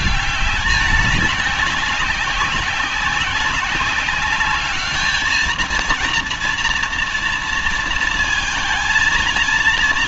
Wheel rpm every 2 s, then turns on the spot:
200, 190, 210, 240, 230.
none